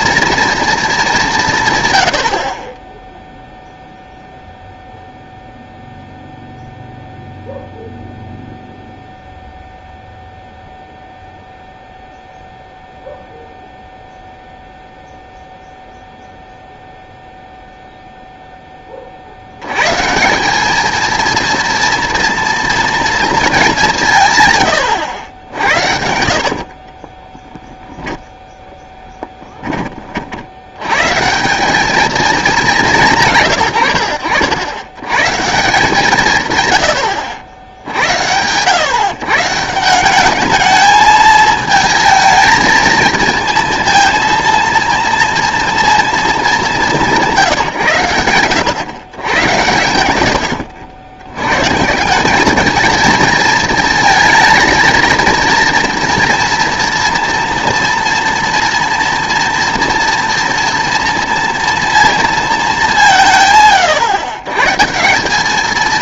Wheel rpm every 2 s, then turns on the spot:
230, 40, 0, 0, 0, 0, 0, 0, 0, 10, 200, 230, 120, 50, 0, 90, 190, 80, 130, 110, 210, 220, 230, 220, 110, 80, 220, 220, 230, 230, 230, 210, 140.
26-28